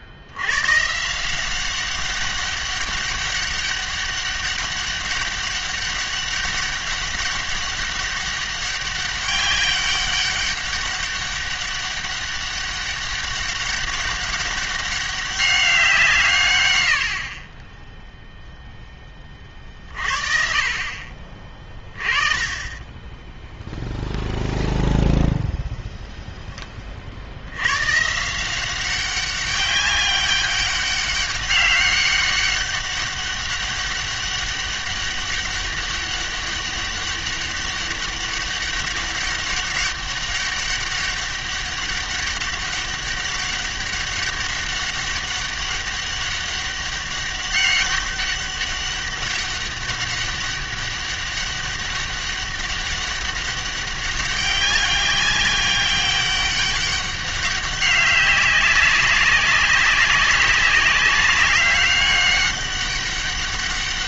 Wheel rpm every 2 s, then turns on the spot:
130, 200, 200, 200, 200, 200, 200, 200, 90, 0, 50, 20, 0, 30, 190, 190, 200, 200, 200, 200, 200, 200, 200, 200, 200, 200, 200, 200, 200, 190, 190, 200.
none